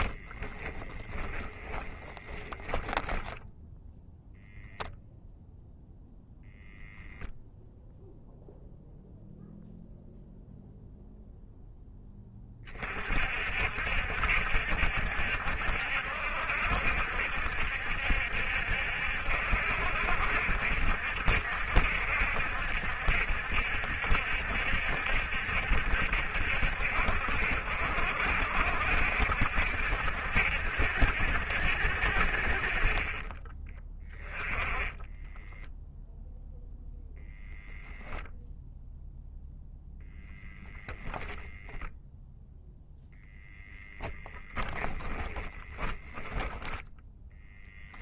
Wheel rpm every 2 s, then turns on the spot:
10, 10, 0, 0, 0, 0, 40, 70, 70, 70, 70, 70, 70, 60, 70, 70, 40, 10, 0, 0, 0, 0, 10, 10.
0-4 34-36 44-46